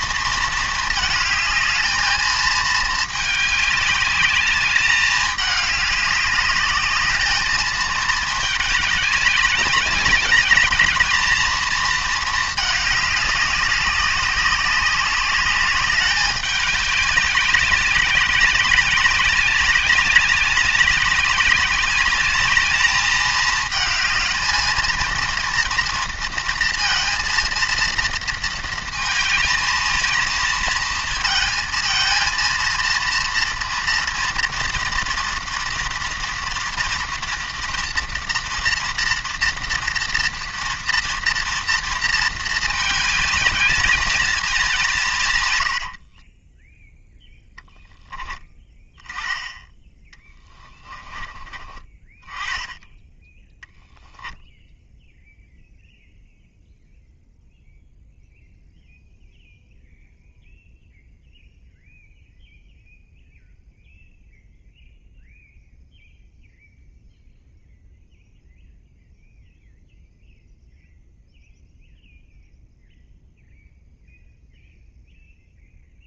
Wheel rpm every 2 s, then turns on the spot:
220, 210, 210, 210, 200, 220, 200, 200, 200, 200, 200, 210, 230, 230, 220, 220, 230, 230, 230, 240, 230, 210, 160, 0, 20, 20, 10, 0, 0, 0, 0, 0, 0, 0, 0, 0, 0, 0.
none